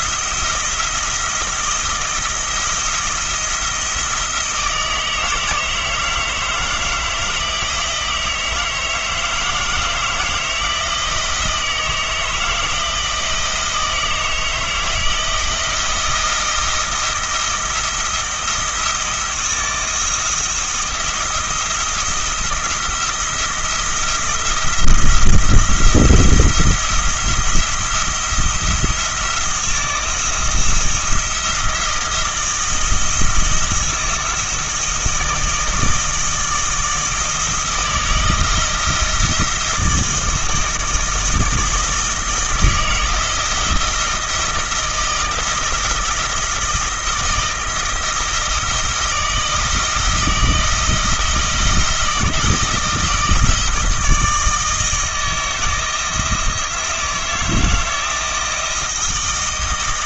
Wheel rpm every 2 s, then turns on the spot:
160, 170, 160, 160, 160, 160, 160, 160, 170, 170, 170, 170, 170, 170, 170, 170, 160, 160, 160, 160, 160, 160, 160, 160, 160, 160, 160, 160, 160, 160.
none